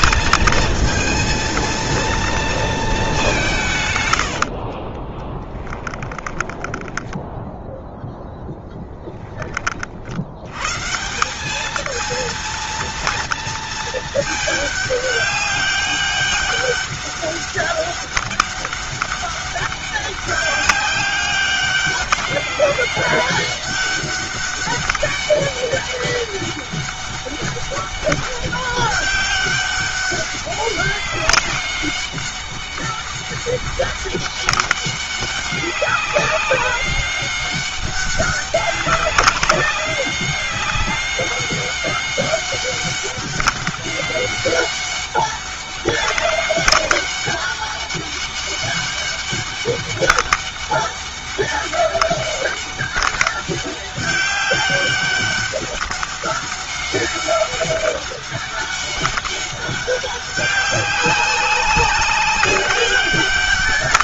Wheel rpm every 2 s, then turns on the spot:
230, 210, 40, 10, 10, 170, 230, 200, 200, 200, 200, 200, 200, 200, 200, 200, 200, 190, 200, 200, 200, 200, 200, 200, 200, 200, 200, 200, 200, 200, 200, 200.
4-8